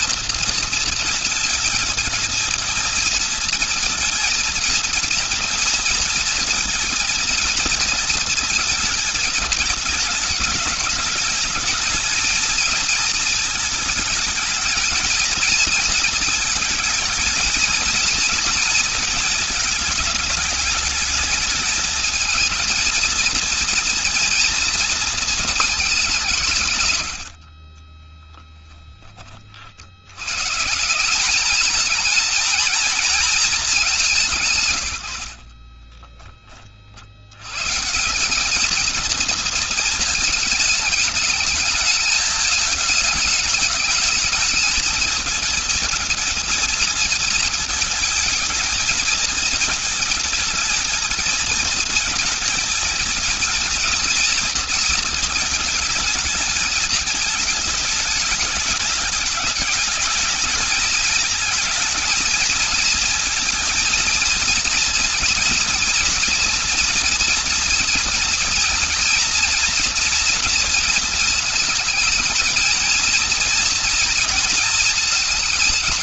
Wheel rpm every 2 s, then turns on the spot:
230, 230, 230, 230, 230, 220, 220, 220, 220, 230, 220, 220, 230, 150, 10, 130, 220, 130, 20, 200, 220, 210, 220, 230, 220, 220, 220, 230, 220, 210, 210, 220, 230, 240, 230, 230, 220, 230.
28-30